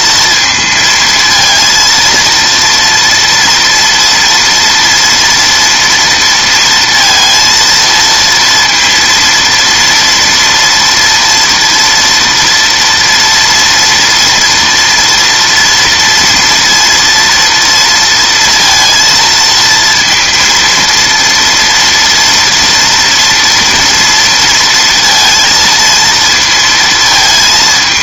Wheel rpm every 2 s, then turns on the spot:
230, 230, 230, 230, 230, 230, 230, 230, 230, 230, 230, 230, 230, 230.
none